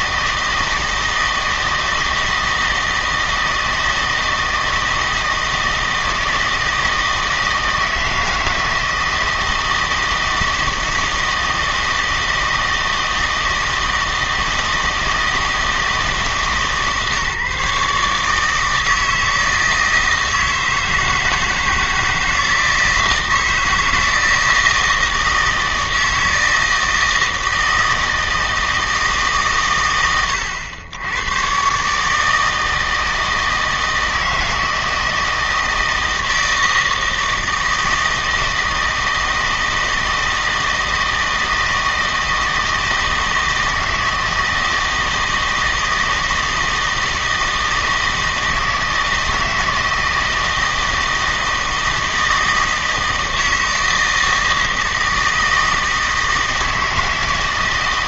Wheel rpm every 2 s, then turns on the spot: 160, 160, 160, 160, 160, 160, 160, 160, 150, 160, 160, 160, 160, 160, 160, 90, 160, 160, 160, 160, 160, 160, 160, 160, 160, 160, 160, 160, 160.
none